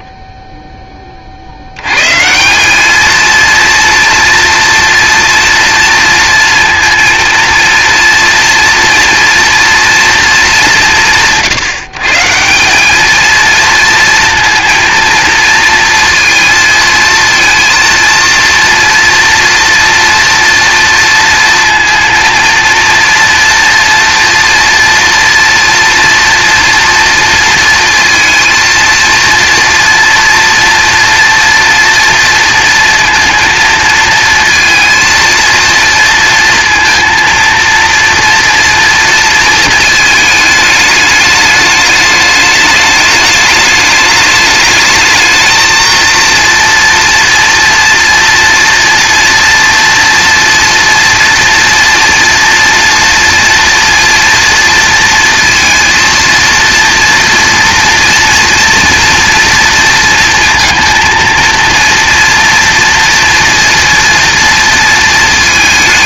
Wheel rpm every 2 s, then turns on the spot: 30, 220, 230, 230, 240, 150, 210, 230, 230, 230, 230, 230, 230, 230, 230, 230, 230, 230, 230, 230, 210, 210, 220, 230, 230, 230, 230, 230, 230, 230, 220, 230, 230.
none